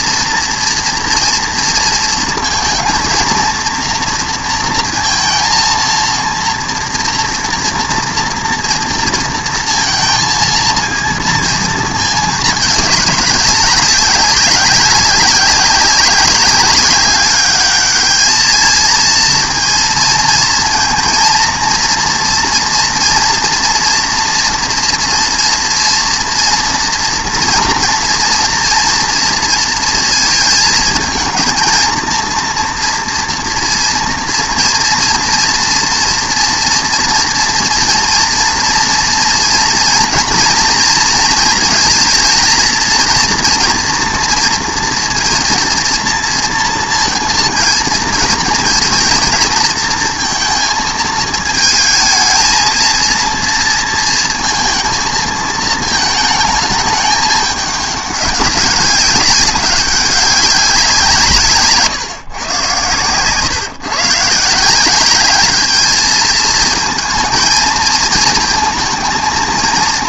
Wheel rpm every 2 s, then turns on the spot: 230, 230, 230, 230, 230, 230, 210, 200, 200, 220, 220, 240, 230, 230, 230, 220, 230, 230, 240, 230, 230, 230, 230, 230, 230, 220, 220, 230, 210, 190, 190, 120, 180, 220, 220.
none